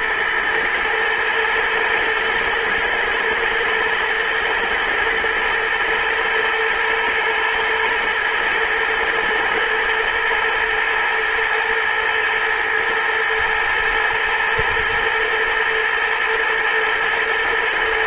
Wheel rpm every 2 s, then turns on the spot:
110, 120, 110, 110, 110, 120, 110, 110, 110.
none